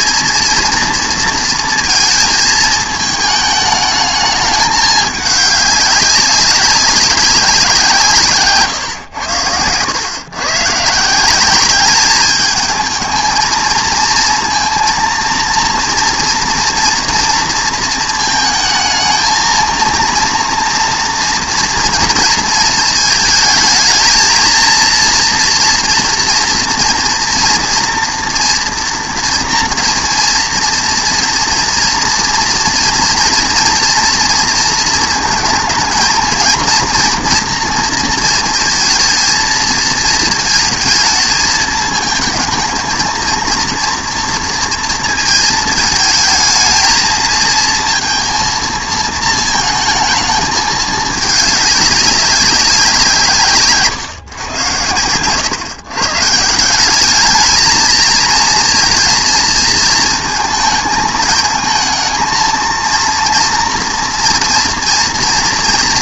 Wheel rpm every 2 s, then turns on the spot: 230, 220, 210, 190, 140, 140, 220, 230, 230, 230, 240, 220, 230, 230, 230, 240, 230, 230, 230, 230, 220, 230, 230, 220, 220, 220, 180, 110, 180, 230, 220, 230, 230.
none